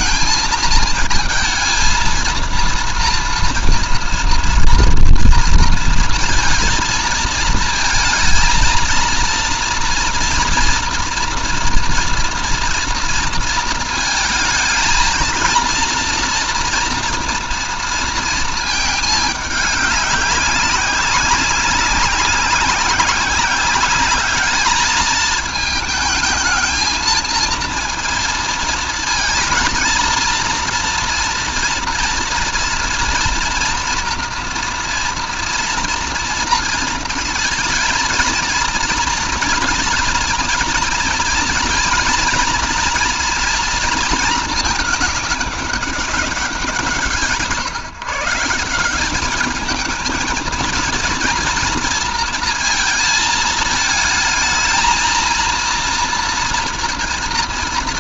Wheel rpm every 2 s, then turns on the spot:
220, 230, 230, 230, 230, 230, 230, 230, 230, 210, 200, 190, 220, 230, 220, 230, 240, 230, 230, 230, 230, 230, 210, 170, 200, 230, 220, 220, 230.
none